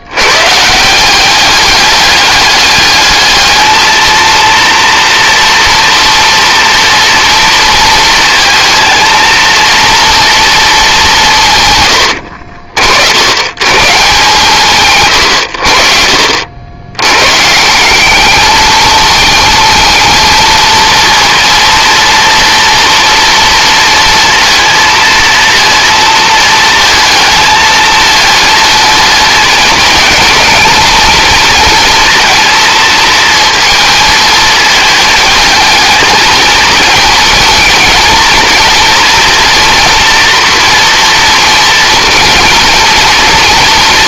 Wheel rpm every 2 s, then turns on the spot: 170, 210, 230, 240, 220, 210, 60, 130, 90, 220, 230, 240, 230, 220, 220, 230, 220, 220, 220, 240, 230, 230.
none